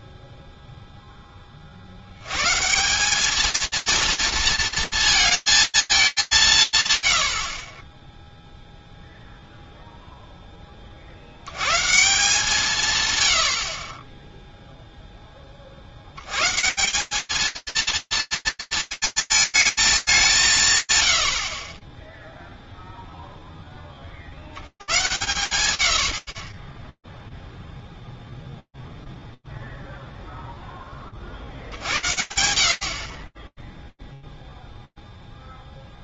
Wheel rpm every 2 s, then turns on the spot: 60, 230, 220, 50, 0, 160, 30, 80, 230, 220, 150, 0, 110, 0, 0, 30, 50, 0.
6-8